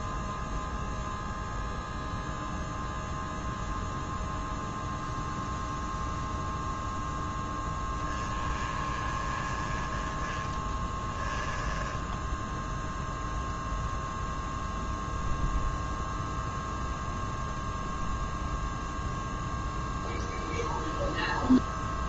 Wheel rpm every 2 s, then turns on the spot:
0, 0, 0, 0, 20, 10, 0, 0, 0, 0, 0.
10-12